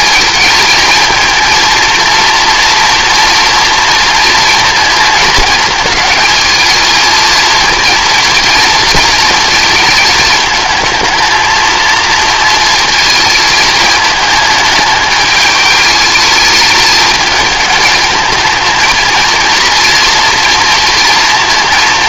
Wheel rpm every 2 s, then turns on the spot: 220, 230, 230, 220, 230, 220, 230, 210, 210, 220, 230.
none